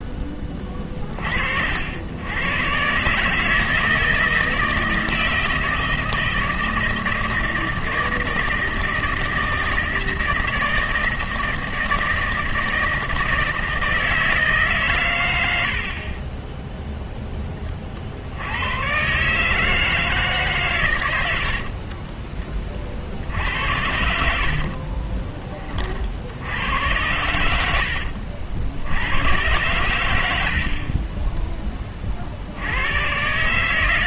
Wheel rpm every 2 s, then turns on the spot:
30, 120, 160, 160, 160, 160, 160, 130, 0, 110, 120, 30, 40, 90, 70, 60, 90.
24-26 30-32